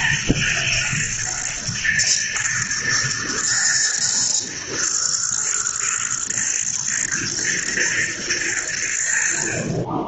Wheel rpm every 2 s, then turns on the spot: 110, 120, 110, 120, 90.
none